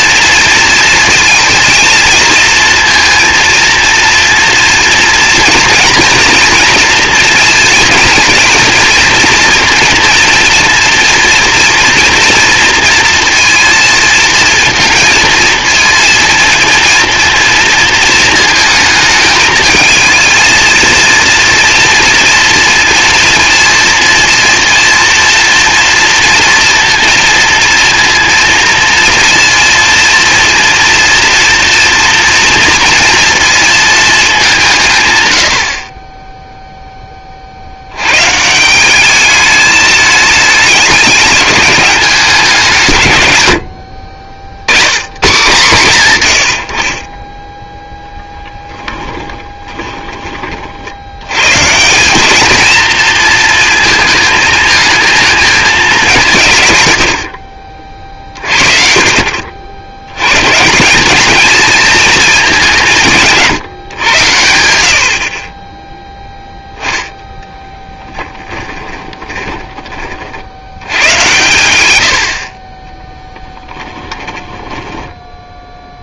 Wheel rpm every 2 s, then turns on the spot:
230, 230, 230, 230, 230, 230, 230, 230, 230, 220, 220, 230, 230, 230, 230, 230, 230, 140, 10, 180, 210, 140, 100, 60, 10, 60, 220, 220, 110, 50, 180, 190, 80, 10, 10, 90, 20, 10.
48-50 68-70 74-76